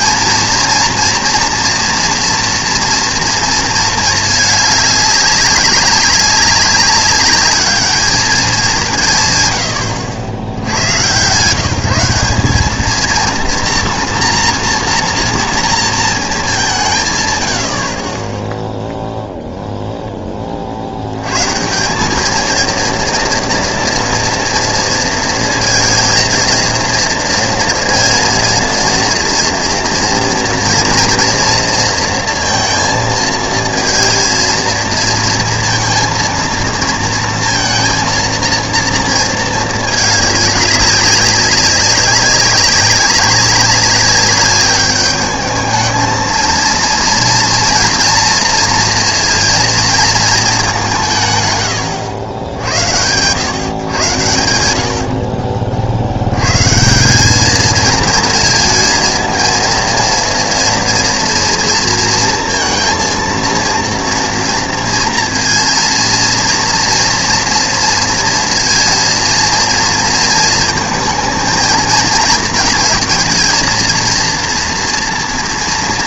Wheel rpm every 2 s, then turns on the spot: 230, 230, 210, 200, 190, 90, 210, 240, 190, 0, 40, 230, 230, 230, 230, 230, 230, 220, 230, 230, 200, 200, 200, 230, 230, 200, 90, 80, 130, 230, 230, 230, 230, 230, 230, 230, 220, 240.
none